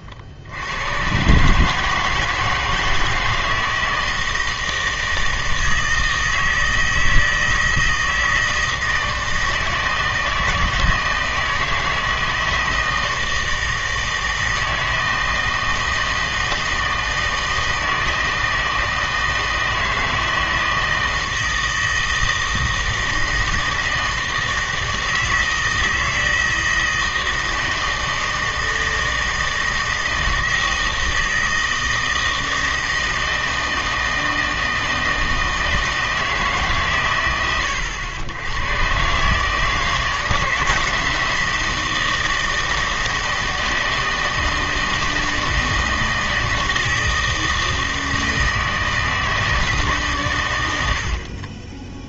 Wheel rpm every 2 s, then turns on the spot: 90, 160, 160, 160, 160, 160, 160, 160, 160, 160, 160, 160, 160, 160, 160, 160, 160, 160, 130, 110, 160, 160, 160, 160, 160, 90.
none